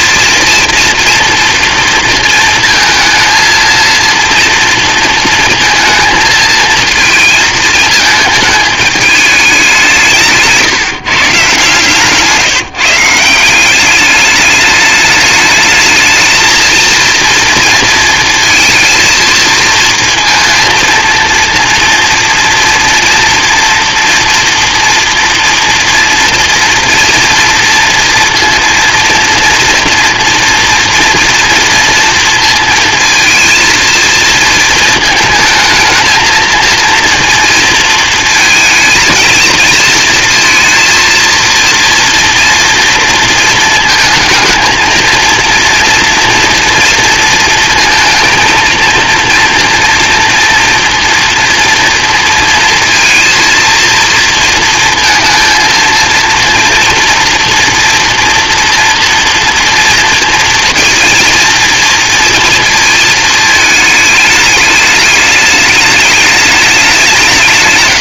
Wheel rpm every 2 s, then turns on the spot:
230, 230, 230, 230, 220, 170, 150, 210, 220, 230, 230, 230, 230, 230, 230, 230, 230, 230, 230, 220, 220, 230, 230, 230, 230, 240, 230, 230, 230, 230, 230, 230, 210, 210.
12-14